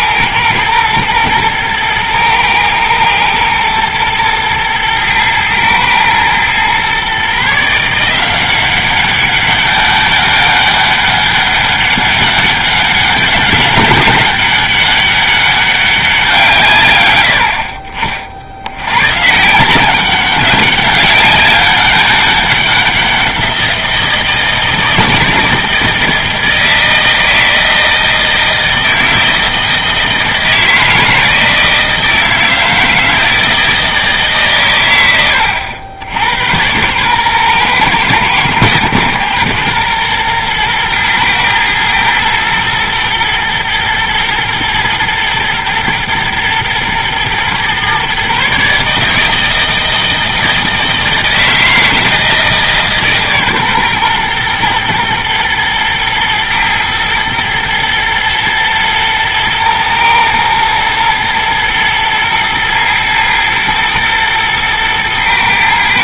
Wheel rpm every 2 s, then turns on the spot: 120, 120, 120, 130, 190, 200, 190, 190, 120, 110, 190, 190, 160, 160, 160, 160, 160, 120, 120, 110, 120, 110, 120, 120, 150, 160, 150, 120, 110, 110, 110, 120, 110.
none